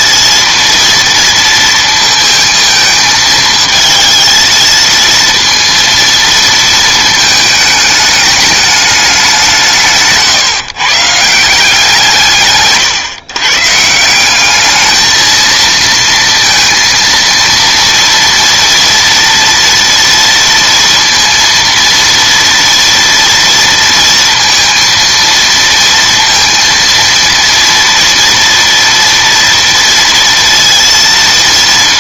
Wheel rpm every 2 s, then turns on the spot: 230, 220, 230, 230, 210, 140, 140, 210, 230, 240, 230, 230, 230, 230, 230, 230.
none